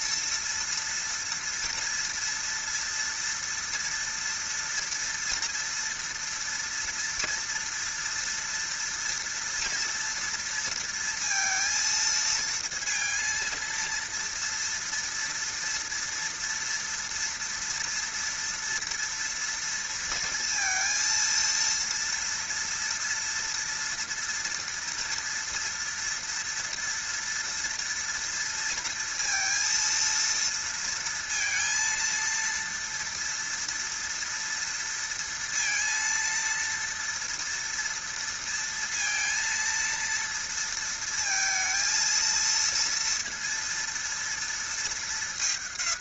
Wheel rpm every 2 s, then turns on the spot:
230, 230, 240, 230, 240, 230, 230, 230, 230, 230, 230, 230, 240, 230, 230, 230, 230, 230, 240, 230, 230, 230, 210.
none